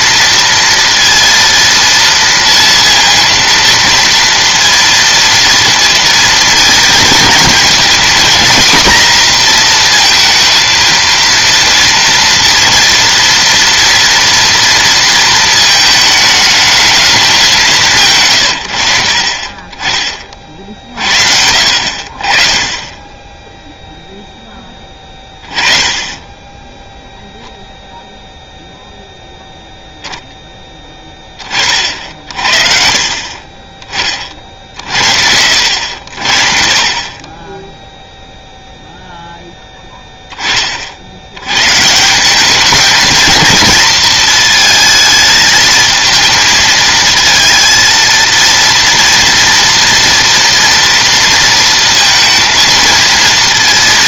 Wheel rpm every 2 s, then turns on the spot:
230, 230, 230, 230, 240, 230, 230, 230, 220, 80, 40, 30, 10, 10, 0, 10, 50, 60, 40, 0, 40, 210, 220, 220, 230, 230, 230.
none